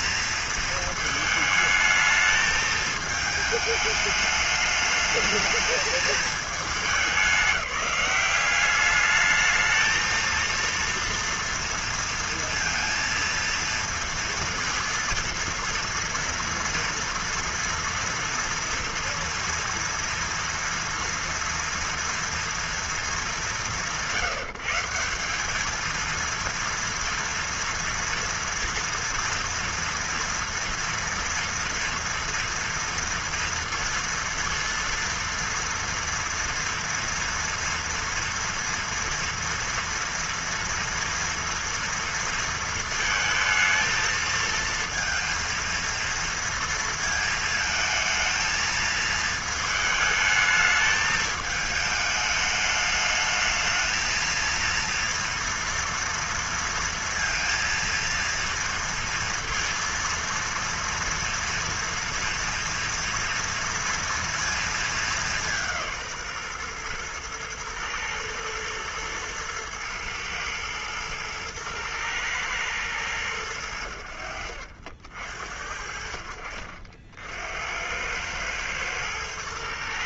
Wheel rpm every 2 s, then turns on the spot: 230, 220, 210, 200, 190, 230, 230, 230, 230, 230, 230, 230, 150, 230, 230, 230, 230, 230, 230, 230, 230, 230, 230, 230, 220, 220, 210, 230, 230, 230, 230, 230, 230, 140, 120, 110, 110, 50, 60, 100.
none